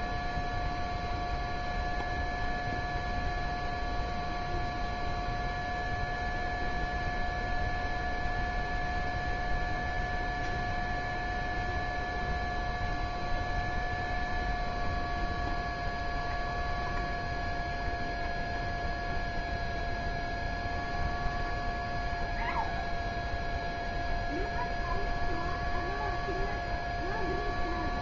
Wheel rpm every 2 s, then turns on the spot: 0, 0, 0, 0, 0, 0, 0, 0, 0, 0, 0, 0, 0, 0.
none